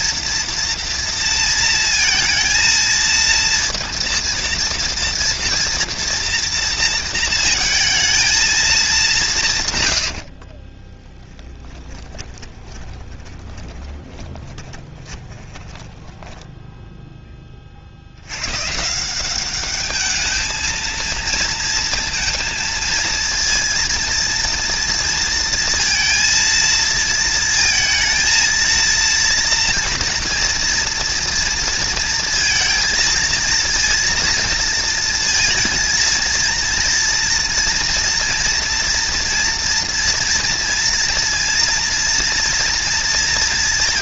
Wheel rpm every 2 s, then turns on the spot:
230, 220, 230, 230, 210, 50, 20, 20, 10, 120, 220, 230, 230, 230, 230, 230, 230, 230, 230, 230, 230, 230.
10-18